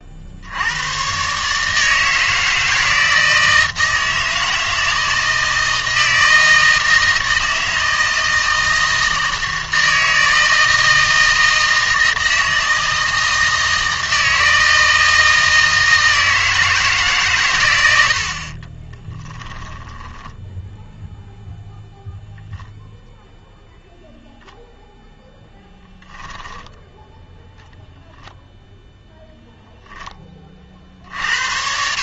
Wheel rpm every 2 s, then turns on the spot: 90, 160, 160, 160, 160, 160, 160, 160, 160, 30, 0, 0, 0, 10, 0, 40.
18-20